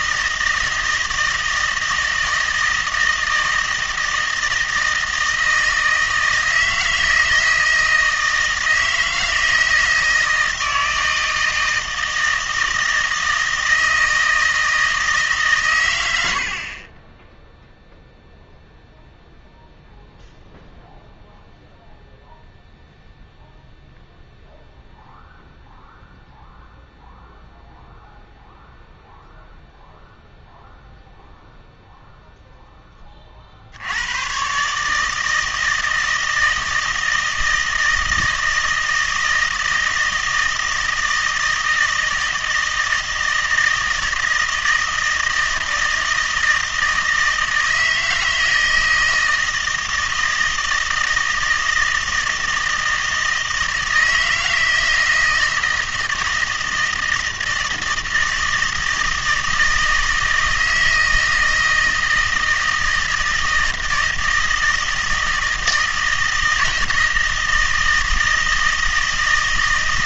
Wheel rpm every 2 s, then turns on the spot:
160, 160, 160, 160, 160, 160, 160, 160, 50, 0, 0, 0, 0, 0, 0, 0, 0, 140, 160, 160, 160, 160, 160, 160, 160, 160, 160, 160, 160, 160, 160, 160, 160, 160, 160.
none